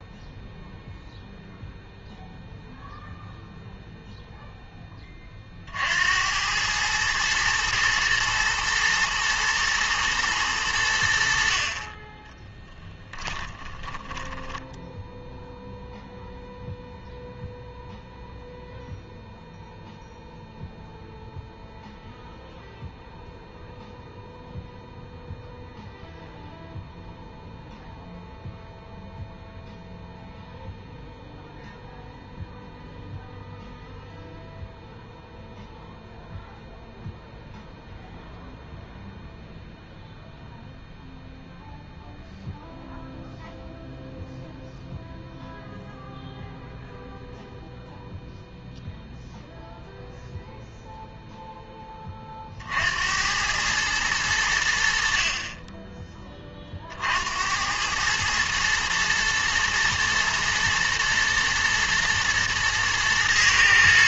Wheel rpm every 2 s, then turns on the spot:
0, 0, 0, 100, 110, 100, 10, 10, 0, 0, 0, 0, 0, 0, 0, 0, 0, 0, 0, 0, 0, 0, 0, 0, 0, 0, 50, 90, 30, 110, 120, 120.
12-16